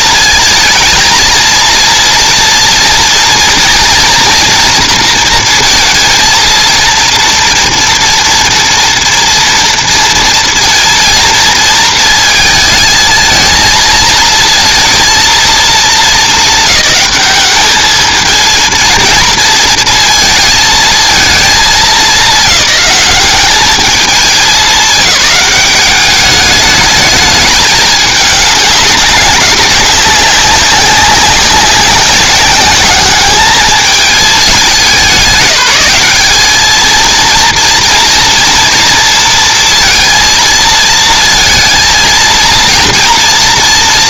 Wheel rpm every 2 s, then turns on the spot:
220, 230, 240, 230, 240, 230, 230, 230, 220, 220, 220, 190, 210, 210, 210, 190, 200, 210, 210, 230, 230, 230.
none